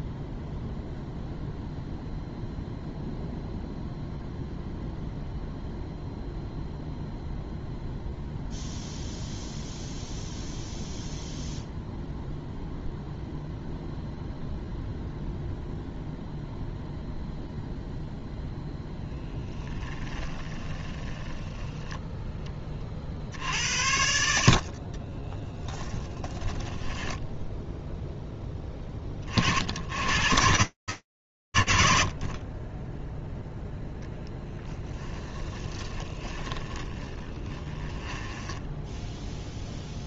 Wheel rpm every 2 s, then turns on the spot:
0, 0, 0, 0, 0, 0, 0, 0, 0, 0, 30, 20, 50, 10, 10, 80, 0, 10, 20, 0.
20-22 24-28 34-38